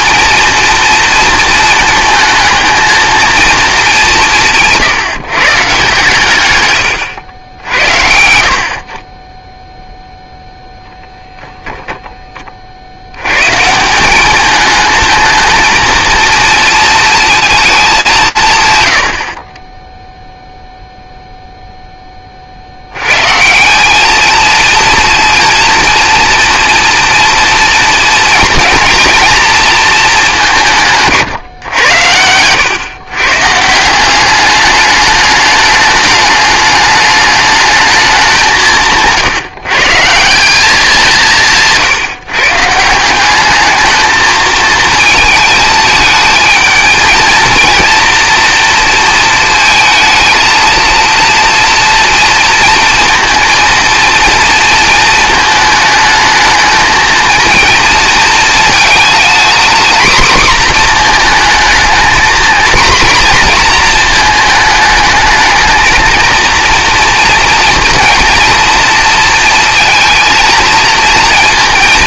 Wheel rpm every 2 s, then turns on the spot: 230, 220, 150, 150, 60, 0, 30, 210, 230, 130, 0, 60, 230, 230, 230, 180, 110, 200, 210, 170, 190, 160, 220, 220, 230, 230, 230, 220, 220, 220, 240, 240, 220, 230, 230, 230.
6-8